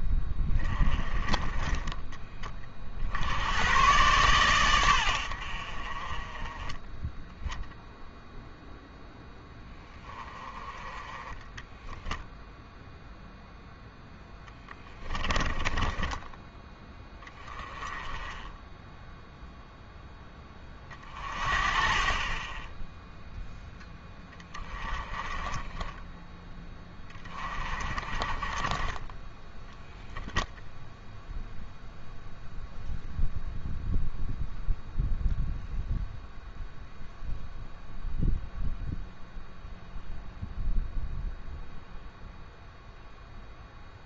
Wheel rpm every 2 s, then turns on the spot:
20, 40, 110, 10, 0, 20, 0, 10, 10, 10, 20, 10, 20, 10, 30, 0, 0, 0, 0, 0, 0, 0.
14-16